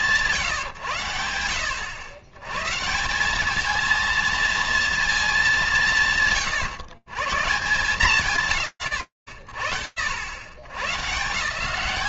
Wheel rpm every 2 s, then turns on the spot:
100, 230, 140, 140, 100, 200.
none